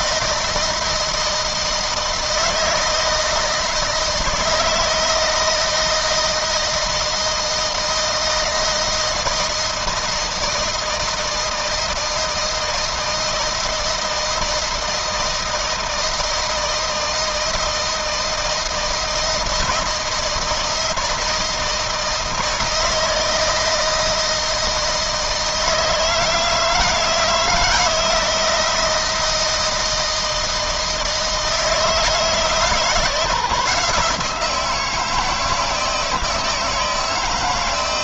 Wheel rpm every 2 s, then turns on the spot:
160, 160, 160, 160, 160, 160, 160, 160, 160, 160, 160, 160, 160, 160, 160, 160, 160, 170, 160.
none